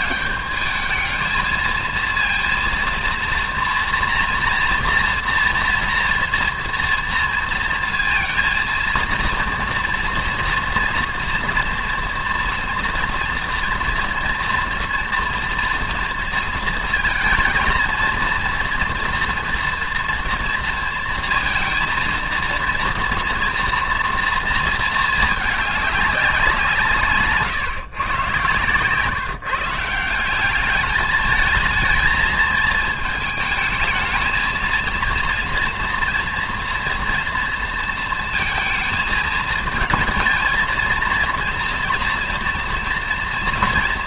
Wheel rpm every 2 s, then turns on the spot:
210, 230, 230, 230, 230, 240, 240, 230, 230, 230, 230, 230, 230, 180, 130, 200, 220, 230, 230, 220, 230, 240.
none